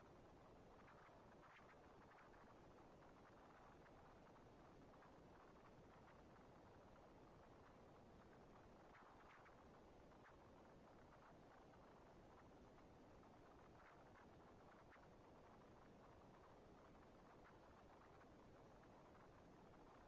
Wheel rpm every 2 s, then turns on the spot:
230, 230, 230, 230, 230, 220, 230, 230, 230, 220.
none